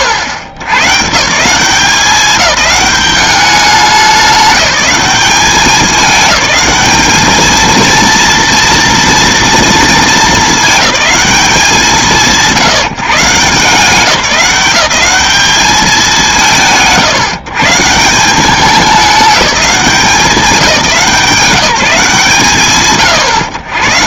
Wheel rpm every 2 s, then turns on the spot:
90, 200, 200, 210, 230, 210, 140, 190, 150, 200, 180, 100.
none